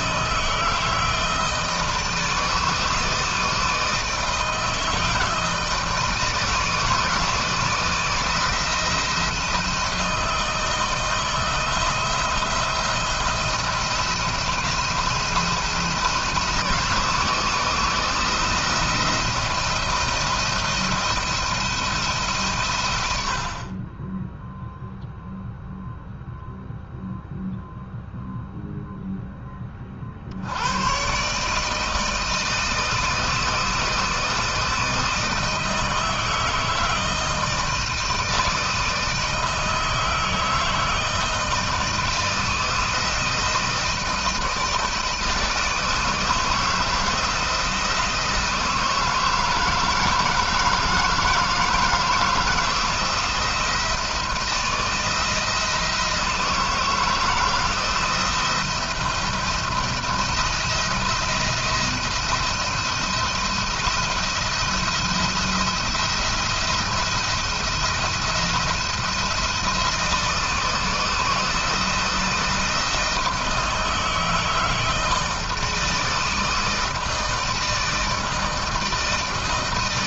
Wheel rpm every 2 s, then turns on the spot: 160, 160, 160, 160, 160, 160, 170, 170, 160, 170, 170, 130, 0, 0, 0, 90, 160, 160, 160, 160, 160, 160, 160, 160, 160, 160, 170, 160, 160, 170, 170, 170, 170, 170, 170, 160, 160, 160, 160, 160.
none